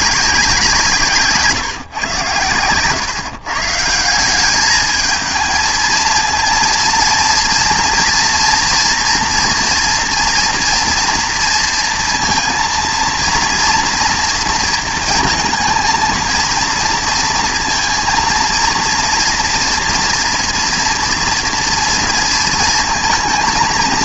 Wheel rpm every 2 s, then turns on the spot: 170, 120, 220, 230, 230, 230, 230, 230, 230, 230, 230, 230.
none